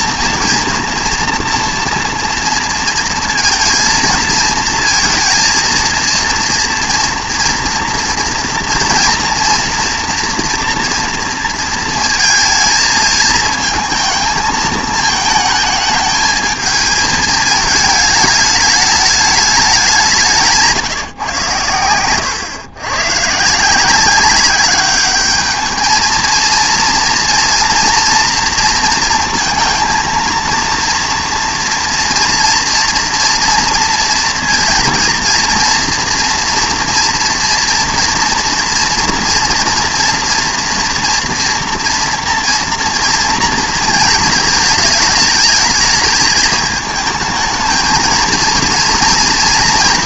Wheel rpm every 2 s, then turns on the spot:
230, 230, 220, 230, 230, 230, 220, 220, 220, 210, 140, 120, 200, 230, 230, 230, 230, 230, 230, 230, 230, 230, 220, 220, 230.
none